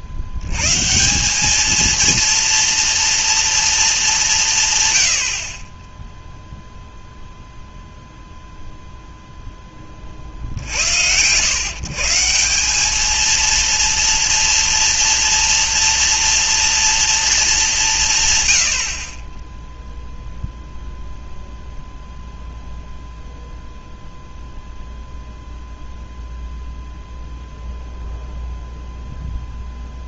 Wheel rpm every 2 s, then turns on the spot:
90, 230, 170, 0, 0, 80, 180, 240, 230, 90, 0, 0, 0, 0, 0.
none